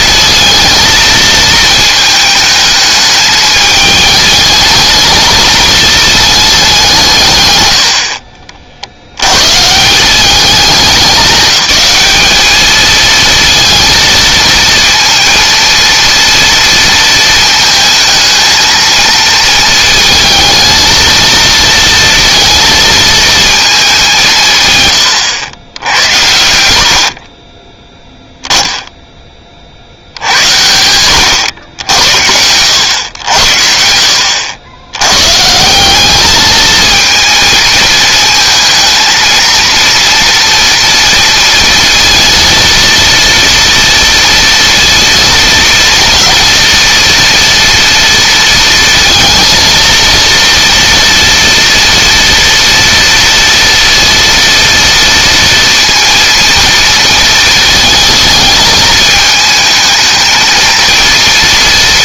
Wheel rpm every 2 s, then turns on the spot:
230, 220, 220, 200, 50, 200, 220, 220, 230, 220, 220, 230, 150, 80, 10, 90, 100, 80, 220, 220, 240, 230, 230, 230, 230, 230, 230, 230, 230, 220, 230.
26-28